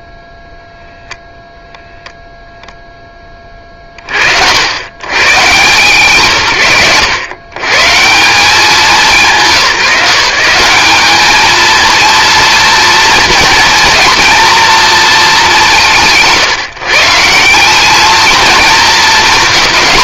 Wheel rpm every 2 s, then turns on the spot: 0, 0, 100, 90, 180, 200, 230, 230, 160, 230.
none